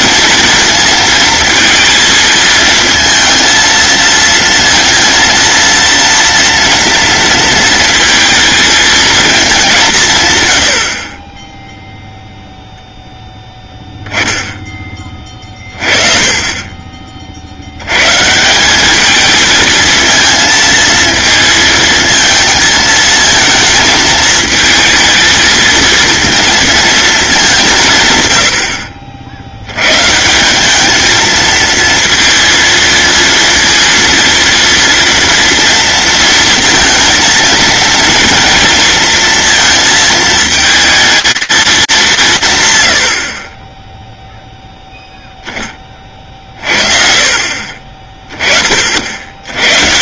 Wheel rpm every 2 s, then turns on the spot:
230, 230, 230, 230, 220, 60, 0, 20, 30, 210, 230, 220, 220, 220, 60, 210, 230, 230, 230, 230, 220, 130, 0, 50, 60.
none